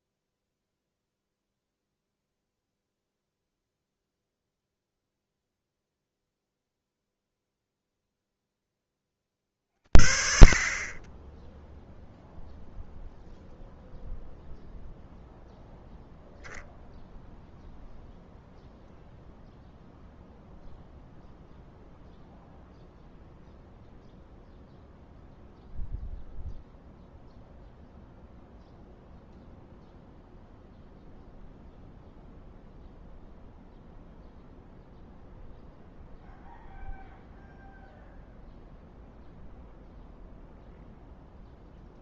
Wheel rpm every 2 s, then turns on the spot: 0, 0, 0, 0, 10, 40, 0, 0, 0, 0, 0, 0, 0, 0, 0, 0, 0, 0, 0, 0, 0.
none